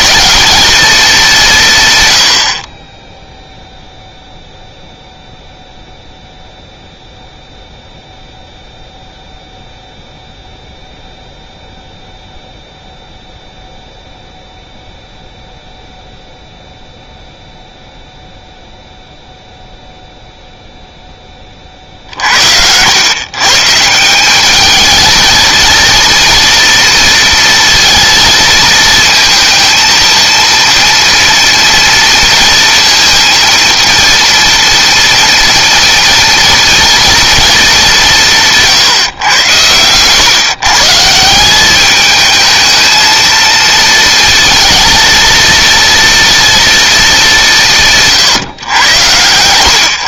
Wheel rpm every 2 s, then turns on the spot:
210, 10, 0, 0, 0, 0, 0, 0, 0, 0, 10, 120, 220, 230, 230, 230, 230, 230, 230, 140, 160, 220, 230, 210, 110.
none